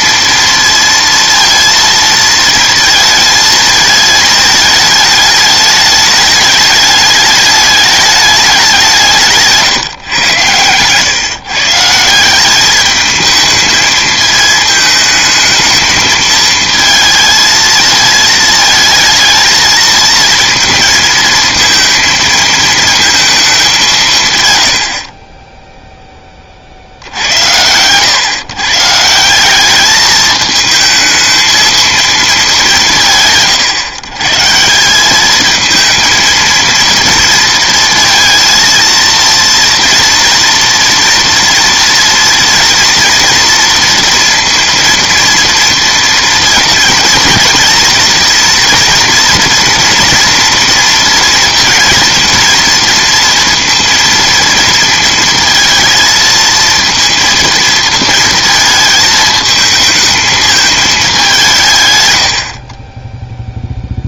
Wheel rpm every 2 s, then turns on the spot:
230, 230, 220, 210, 190, 110, 200, 220, 220, 220, 230, 220, 120, 50, 140, 220, 200, 160, 230, 230, 230, 230, 230, 230, 240, 230, 230, 230, 220, 220, 220, 40.
10-12